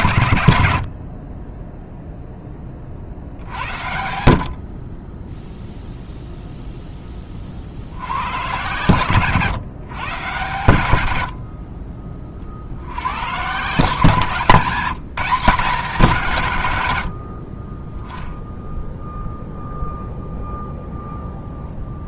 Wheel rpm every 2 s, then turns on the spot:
60, 40, 40, 10, 110, 90, 80, 180, 110, 0, 0.
none